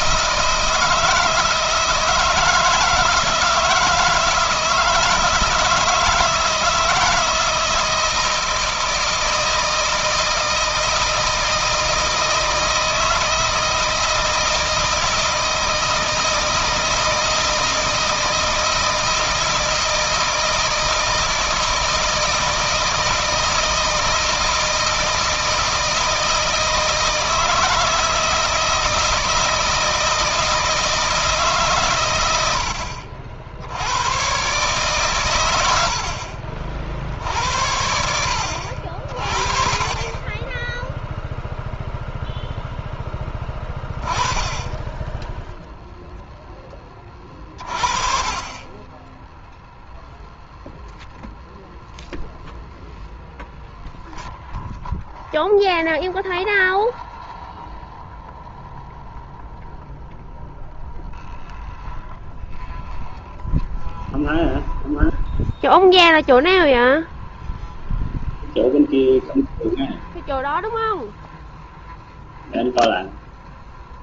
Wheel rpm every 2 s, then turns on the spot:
160, 160, 160, 160, 160, 160, 160, 160, 160, 160, 160, 160, 160, 160, 160, 160, 70, 140, 70, 70, 0, 10, 10, 20, 20, 0, 0, 0, 0, 0, 0, 0, 0, 0, 0, 0, 0.
none